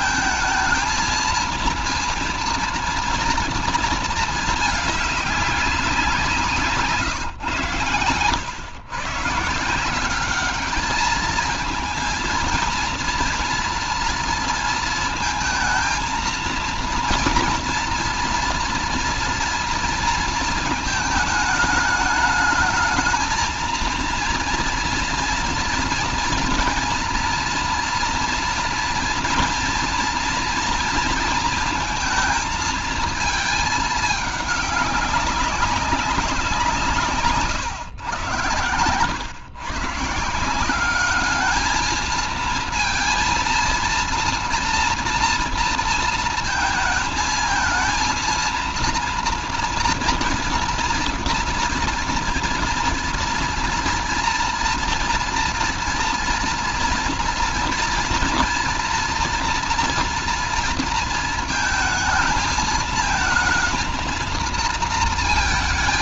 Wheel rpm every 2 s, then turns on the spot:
220, 230, 220, 160, 110, 210, 230, 230, 230, 240, 220, 220, 230, 240, 230, 230, 230, 210, 180, 120, 180, 230, 230, 220, 230, 230, 230, 230, 230, 240, 230, 220, 230.
none